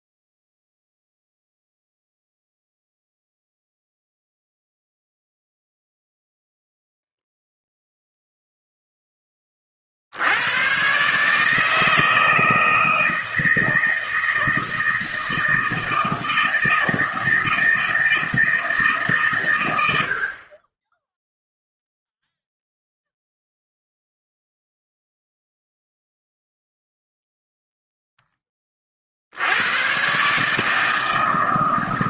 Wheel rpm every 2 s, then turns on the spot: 0, 0, 0, 0, 0, 110, 160, 160, 160, 160, 10, 0, 0, 0, 20, 150.
none